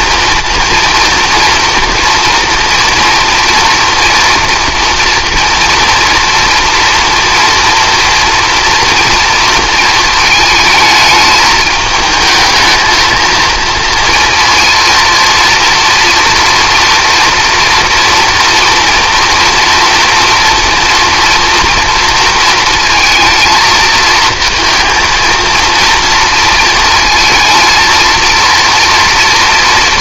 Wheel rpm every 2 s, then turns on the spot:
230, 230, 230, 230, 230, 220, 220, 230, 230, 240, 240, 230, 230, 230, 230.
none